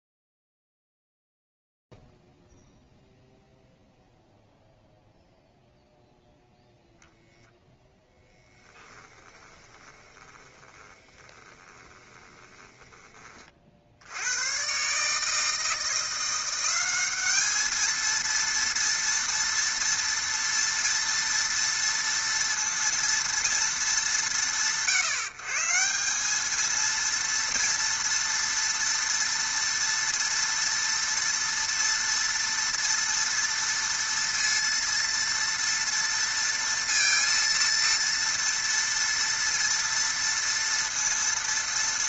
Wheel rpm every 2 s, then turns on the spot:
0, 0, 0, 0, 10, 30, 20, 110, 180, 230, 230, 230, 130, 210, 230, 230, 230, 230, 230, 230, 230.
8-14